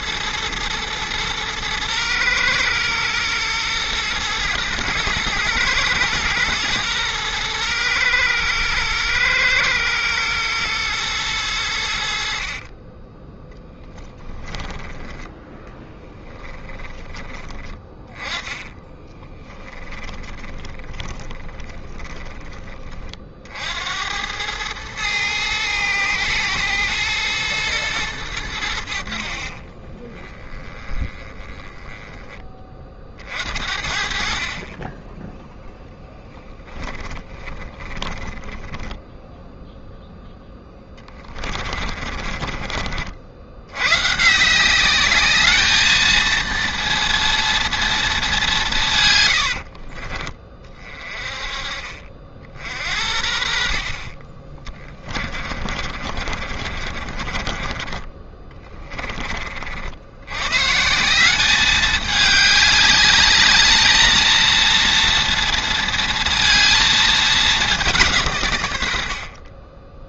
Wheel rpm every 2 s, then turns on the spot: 110, 110, 110, 110, 110, 110, 30, 20, 20, 20, 20, 40, 110, 110, 70, 20, 40, 20, 10, 10, 20, 50, 200, 230, 140, 30, 60, 20, 30, 20, 160, 210, 230, 220, 100.
12-14 16-22 30-32 36-42 54-58 68-70